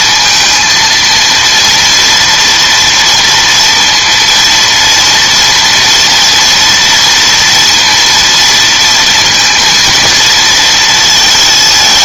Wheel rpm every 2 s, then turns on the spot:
230, 240, 230, 230, 230, 220.
none